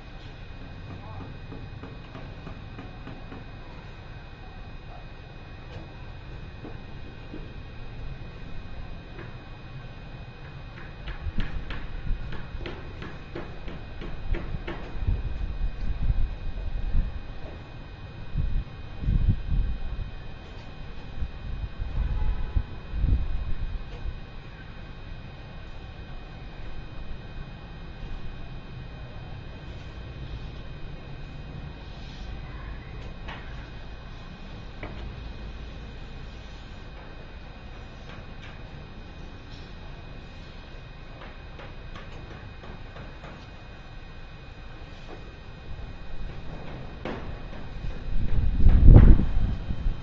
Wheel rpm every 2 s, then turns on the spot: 0, 0, 0, 0, 0, 0, 0, 0, 0, 0, 0, 0, 0, 0, 0, 0, 0, 0, 0, 0, 0, 0, 0, 0, 0.
none